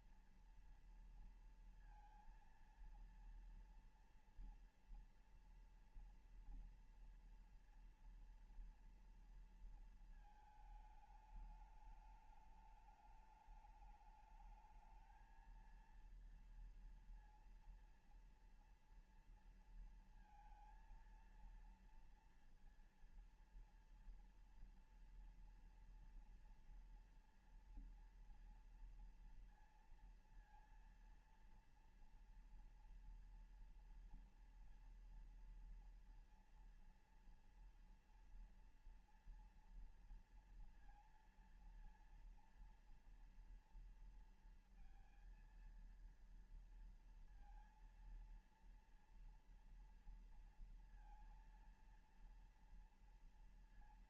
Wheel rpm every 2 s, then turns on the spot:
230, 230, 230, 230, 230, 220, 210, 210, 230, 230, 230, 230, 240, 230, 230, 230, 230, 230, 230, 230, 230, 230, 230, 230, 230, 230, 230.
none